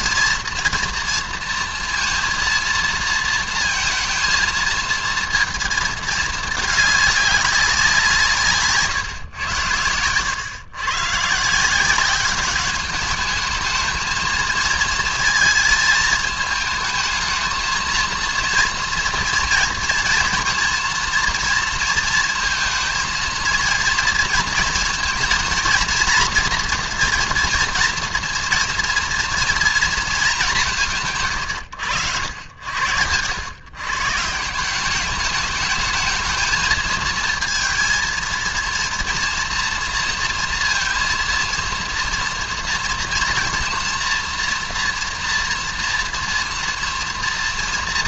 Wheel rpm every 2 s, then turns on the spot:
230, 230, 220, 210, 150, 120, 200, 220, 220, 230, 230, 230, 230, 240, 240, 190, 90, 170, 220, 230, 230, 230, 230, 230.
none